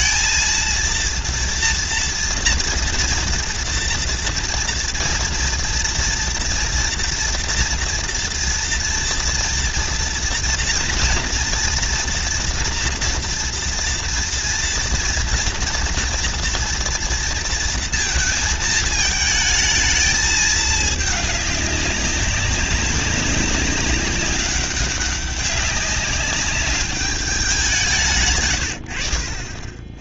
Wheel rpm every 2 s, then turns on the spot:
230, 230, 230, 230, 230, 230, 230, 230, 230, 220, 210, 200, 200, 200, 100.
none